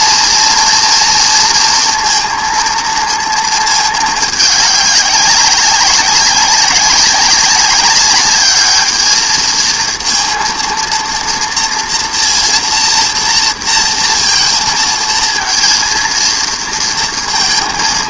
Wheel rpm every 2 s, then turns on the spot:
230, 230, 210, 190, 200, 230, 230, 230, 230.
none